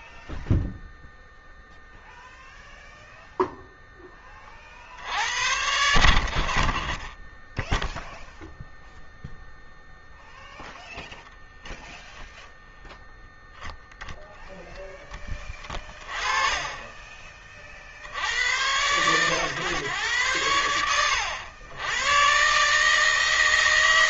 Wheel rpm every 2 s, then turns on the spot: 0, 0, 30, 50, 0, 0, 0, 10, 20, 120, 80, 130.
none